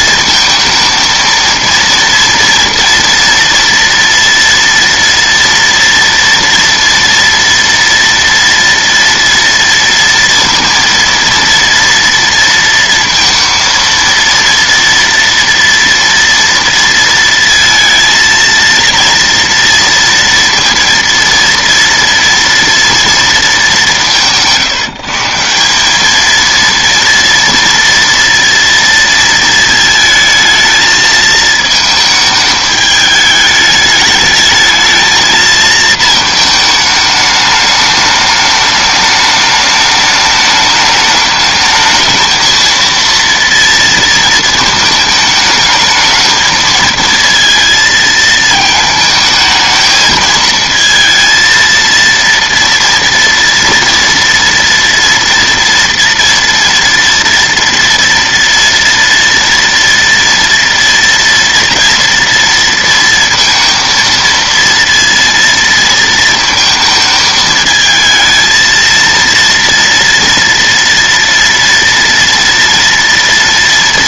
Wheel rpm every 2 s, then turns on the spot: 220, 230, 230, 240, 230, 230, 230, 230, 230, 230, 230, 230, 160, 230, 230, 220, 210, 220, 220, 210, 210, 230, 220, 220, 220, 220, 230, 230, 230, 230, 230, 230, 230, 220, 220, 230, 230.
none